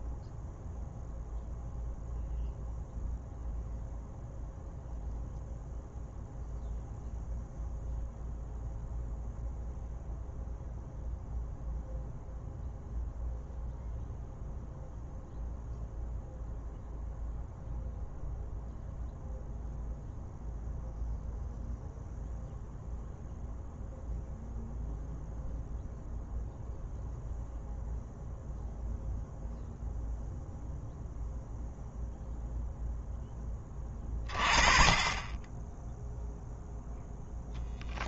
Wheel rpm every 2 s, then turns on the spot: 0, 0, 0, 0, 0, 0, 0, 0, 0, 0, 0, 0, 0, 0, 0, 0, 0, 30, 0.
none